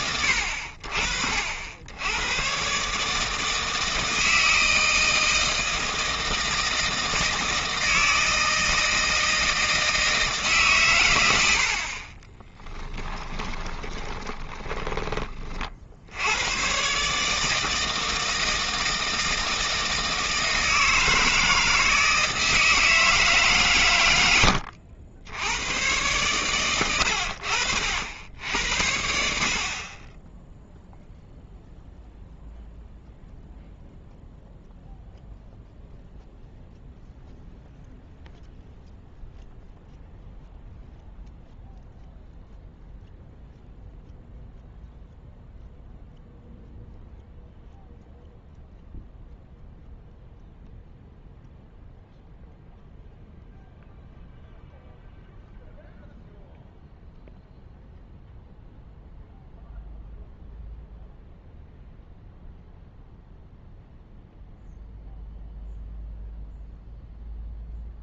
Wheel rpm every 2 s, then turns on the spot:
70, 140, 160, 160, 160, 120, 10, 20, 130, 160, 160, 160, 80, 90, 80, 0, 0, 0, 0, 0, 0, 0, 0, 0, 0, 0, 0, 0, 0, 0, 0, 0, 0, 0.
12-16